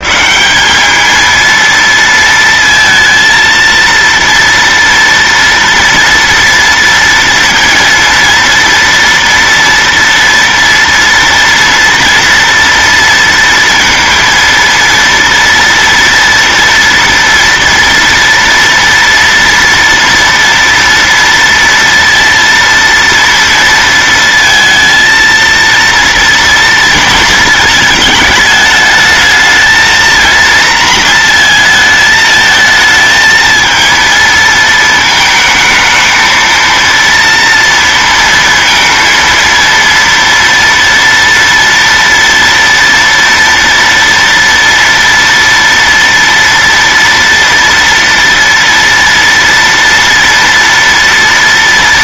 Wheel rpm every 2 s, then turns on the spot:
210, 230, 230, 230, 230, 230, 230, 230, 230, 230, 230, 230, 230, 230, 220, 230, 220, 220, 230, 230, 230, 230, 230, 230, 230, 230.
none